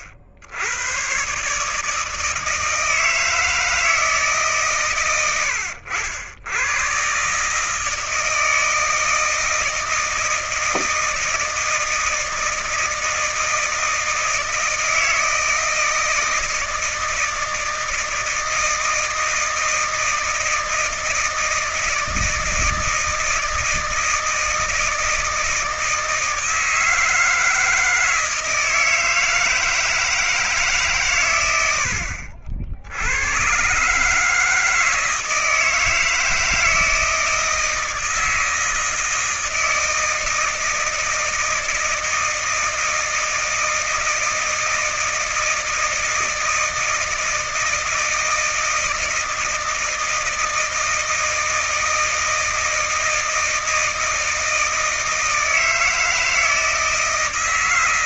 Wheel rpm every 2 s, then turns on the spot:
90, 150, 140, 90, 160, 160, 160, 160, 160, 160, 160, 160, 160, 160, 160, 160, 70, 150, 160, 160, 160, 160, 160, 160, 160, 160, 160, 160, 160.
none